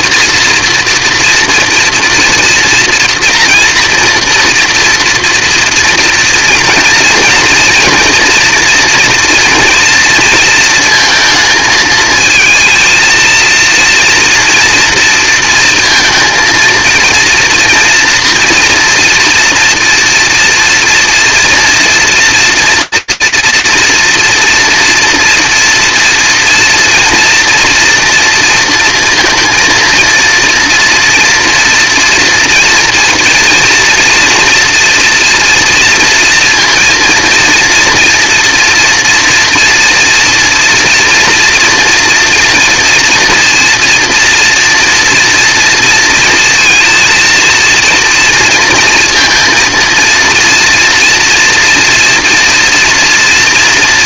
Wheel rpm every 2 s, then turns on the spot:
230, 230, 230, 230, 230, 230, 230, 230, 230, 240, 230, 230, 240, 230, 230, 230, 240, 230, 230, 230, 230, 230, 240, 230, 230, 240, 230.
none